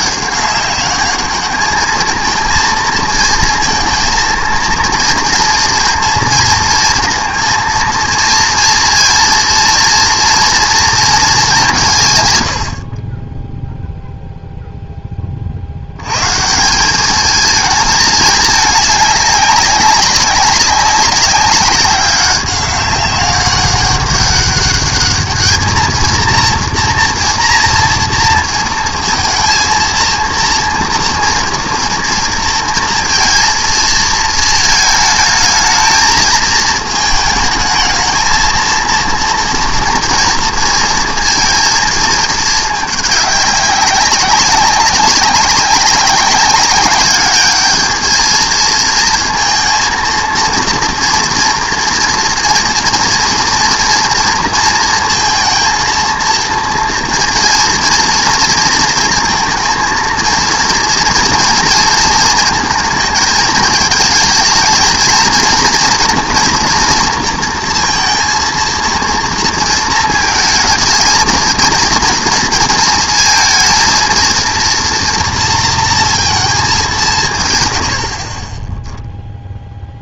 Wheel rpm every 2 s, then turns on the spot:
210, 230, 230, 230, 230, 210, 10, 20, 210, 200, 190, 200, 210, 230, 230, 230, 230, 220, 220, 230, 230, 210, 200, 200, 230, 230, 240, 230, 230, 230, 230, 220, 220, 230, 230, 220, 230, 230, 170, 0.
none